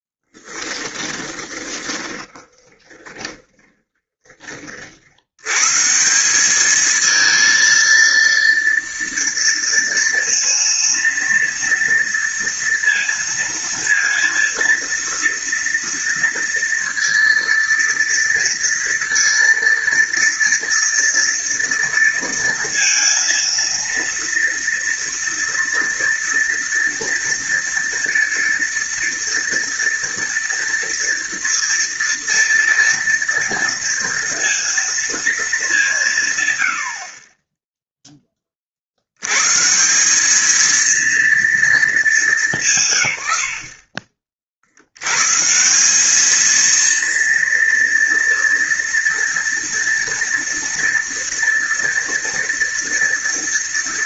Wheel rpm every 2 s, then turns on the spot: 10, 20, 40, 210, 230, 230, 230, 230, 230, 230, 230, 230, 230, 230, 230, 230, 240, 230, 60, 60, 230, 150, 80, 230, 230, 230, 230.
0-4